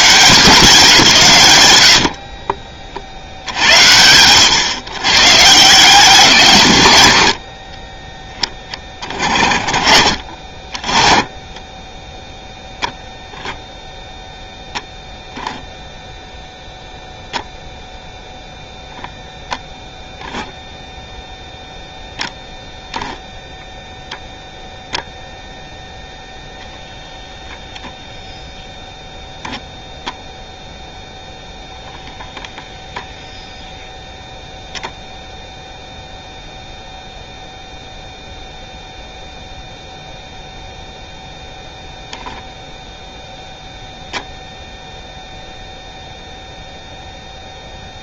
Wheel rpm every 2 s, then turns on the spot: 170, 30, 120, 130, 30, 40, 0, 0, 0, 0, 0, 0, 0, 0, 0, 0, 0, 0, 0, 0, 0, 10, 0, 0.
none